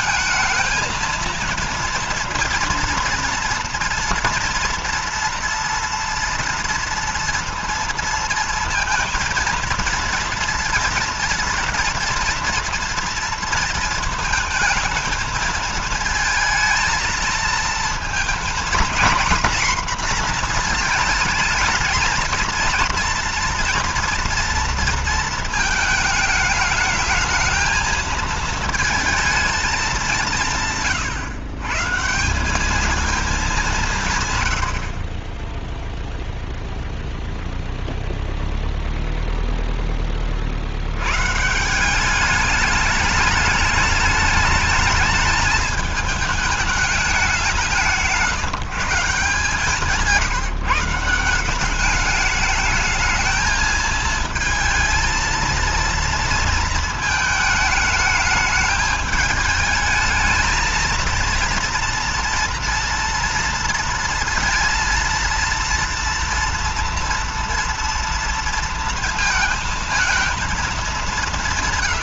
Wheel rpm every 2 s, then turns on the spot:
220, 230, 230, 230, 230, 230, 230, 220, 220, 230, 230, 230, 230, 220, 220, 150, 190, 100, 0, 0, 60, 210, 210, 210, 170, 170, 210, 230, 230, 210, 220, 230, 230, 230, 230, 220.
none